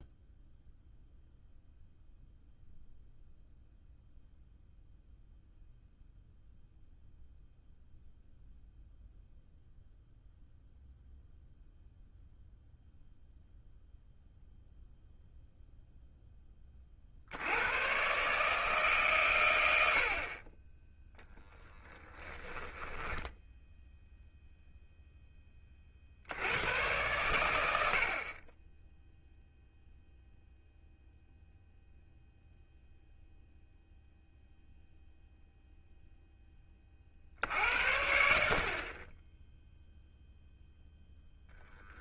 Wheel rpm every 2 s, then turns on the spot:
0, 0, 0, 0, 0, 0, 0, 0, 30, 150, 20, 10, 0, 110, 10, 0, 0, 0, 40, 40, 10.
22-24